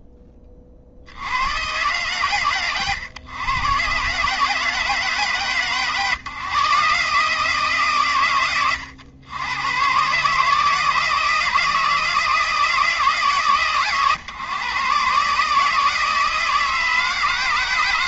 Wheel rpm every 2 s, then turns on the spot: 50, 110, 140, 160, 100, 160, 140, 130, 160.
none